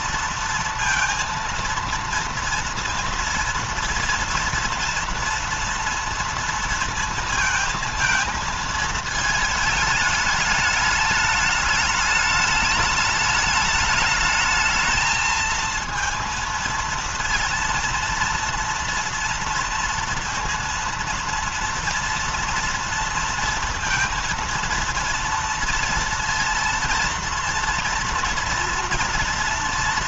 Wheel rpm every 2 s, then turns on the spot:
230, 230, 230, 230, 220, 210, 210, 220, 230, 230, 230, 230, 230, 230, 230.
none